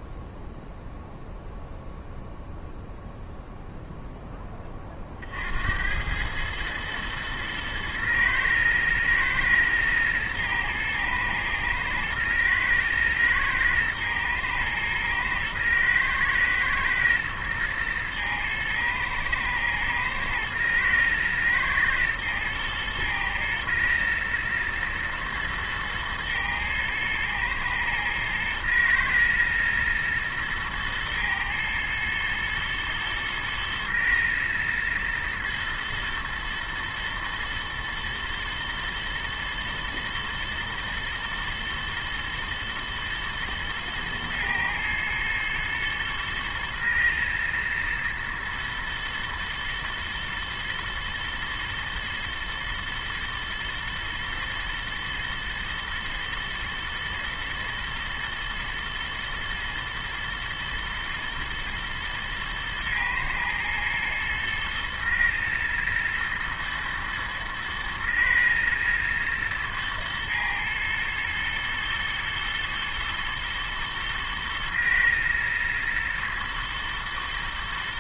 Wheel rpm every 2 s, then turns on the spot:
0, 0, 30, 110, 110, 120, 110, 120, 110, 120, 110, 110, 110, 110, 110, 110, 110, 110, 120, 120, 110, 110, 120, 120, 120, 120, 110, 110, 110, 120, 110, 110, 120, 110, 110, 120, 110, 110, 110.
none